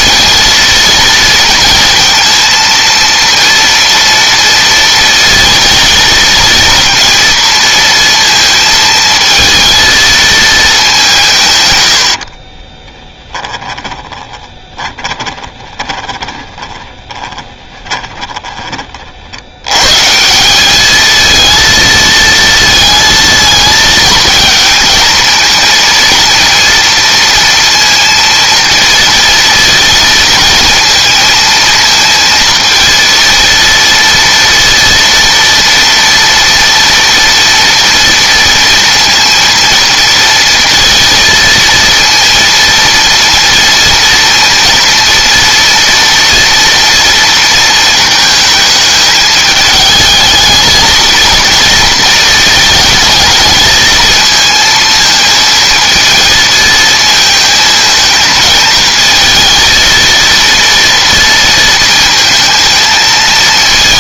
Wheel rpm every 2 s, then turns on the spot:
230, 230, 230, 230, 220, 200, 30, 30, 20, 30, 200, 230, 230, 230, 230, 230, 230, 230, 230, 230, 230, 230, 230, 230, 220, 220, 220, 230, 220, 220, 230, 220.
12-18